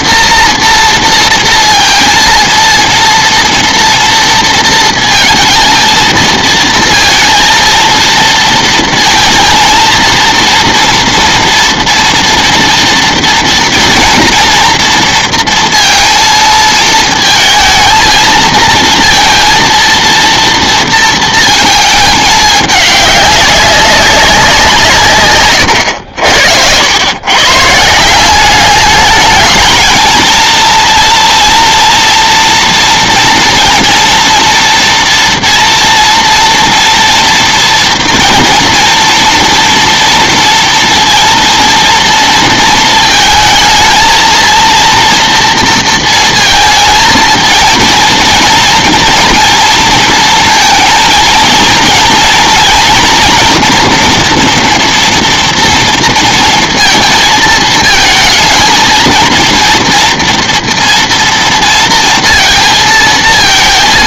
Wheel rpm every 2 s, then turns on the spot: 230, 230, 230, 230, 230, 230, 230, 230, 230, 220, 230, 210, 180, 80, 200, 230, 230, 240, 230, 230, 230, 230, 230, 230, 230, 220, 240, 240, 230, 230, 230, 230.
none